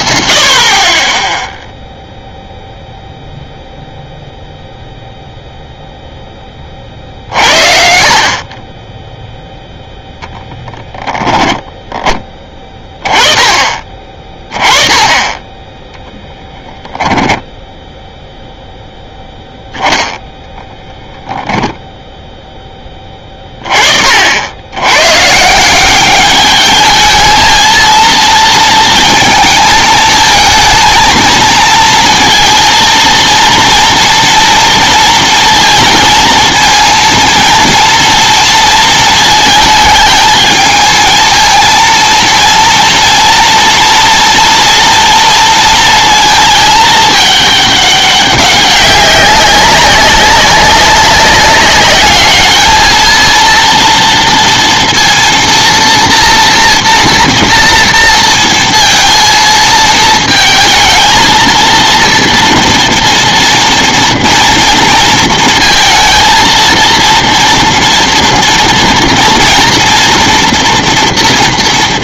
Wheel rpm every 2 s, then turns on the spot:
40, 0, 0, 30, 20, 0, 20, 30, 10, 0, 0, 10, 80, 210, 230, 220, 230, 230, 220, 230, 220, 230, 230, 220, 200, 200, 220, 230, 230, 230, 220, 230, 230, 230, 240, 240.
16-18